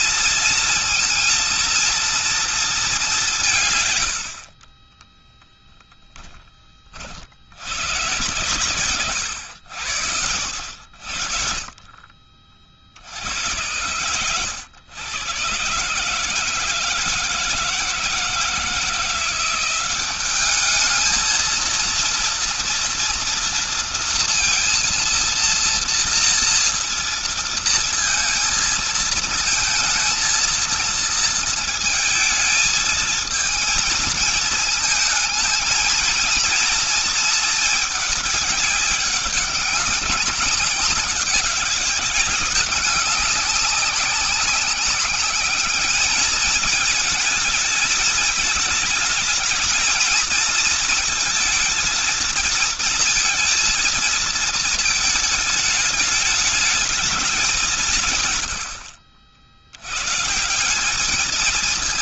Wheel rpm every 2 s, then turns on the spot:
230, 210, 40, 40, 110, 70, 50, 120, 160, 170, 220, 230, 230, 230, 220, 230, 220, 220, 230, 200, 200, 200, 190, 210, 220, 230, 230, 220, 210, 80, 190.
10-12 58-60